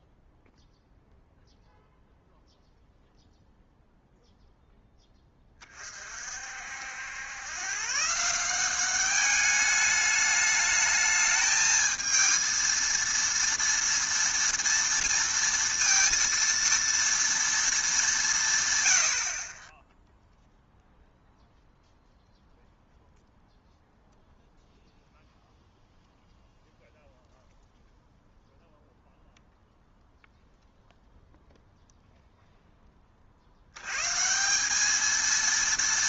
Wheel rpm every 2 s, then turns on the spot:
0, 0, 0, 60, 180, 210, 230, 230, 230, 150, 0, 0, 0, 0, 0, 0, 0, 180.
none